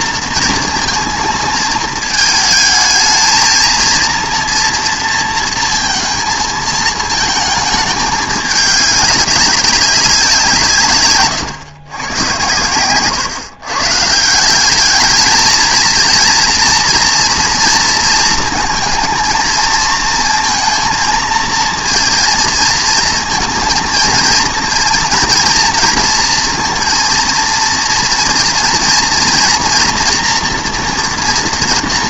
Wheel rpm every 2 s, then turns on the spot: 230, 220, 230, 220, 200, 140, 120, 210, 240, 230, 230, 230, 230, 230, 230, 230.
none